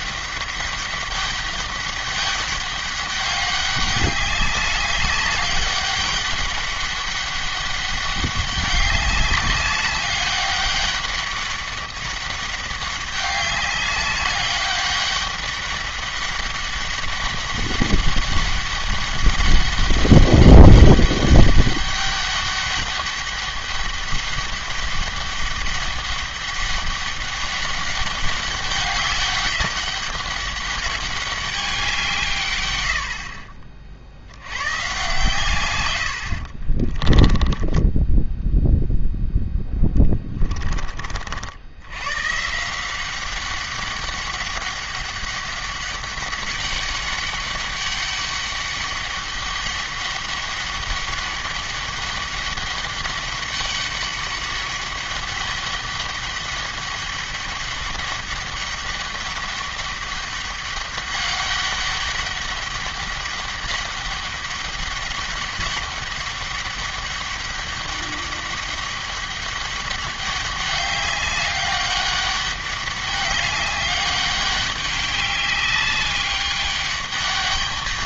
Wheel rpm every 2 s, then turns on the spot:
200, 200, 200, 200, 200, 200, 200, 200, 200, 200, 200, 200, 200, 200, 200, 200, 100, 120, 30, 0, 30, 170, 200, 200, 200, 200, 200, 200, 200, 200, 200, 190, 200, 200, 200, 200, 200, 200, 200.
36-38